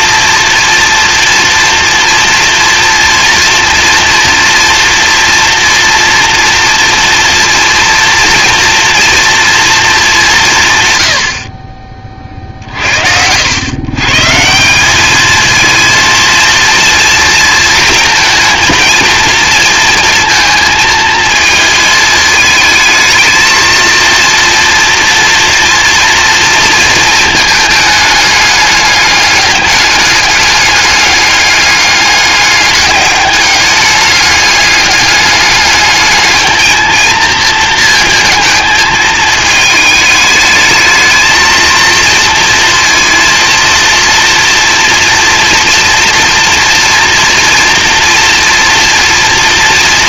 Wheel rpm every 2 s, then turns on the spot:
230, 230, 230, 230, 230, 130, 60, 200, 230, 220, 220, 220, 230, 230, 210, 210, 200, 200, 220, 220, 220, 230, 230, 230, 240.
none